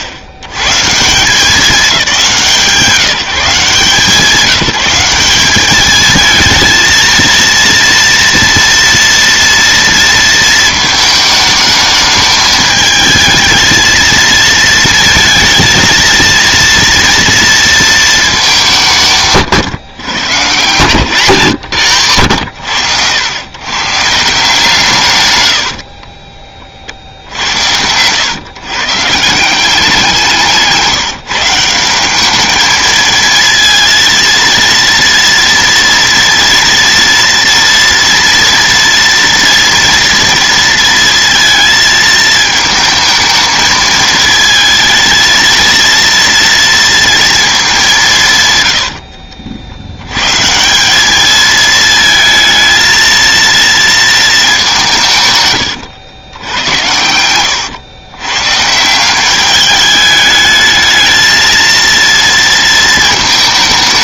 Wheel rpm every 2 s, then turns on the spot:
70, 170, 190, 220, 230, 220, 220, 230, 230, 190, 140, 90, 160, 30, 130, 170, 220, 230, 230, 230, 230, 220, 220, 230, 140, 190, 230, 190, 90, 130, 210, 230.
48-50